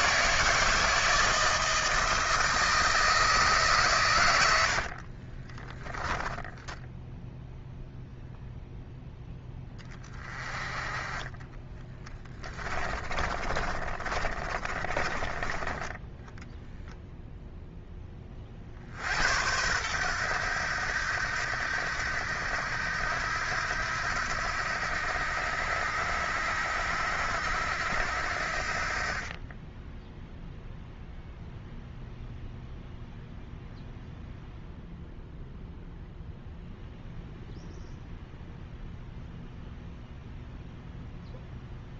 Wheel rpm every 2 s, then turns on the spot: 160, 160, 80, 10, 0, 20, 20, 30, 0, 40, 90, 80, 80, 80, 60, 0, 0, 0, 0, 0, 0.
4-8 12-16